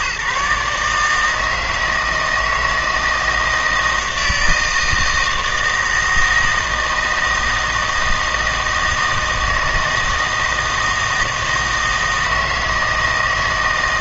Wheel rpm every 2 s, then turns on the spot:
150, 160, 160, 160, 160, 160, 160.
none